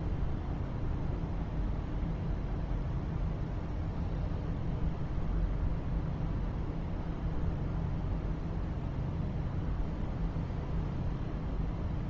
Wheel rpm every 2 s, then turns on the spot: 0, 0, 0, 0, 0, 0.
none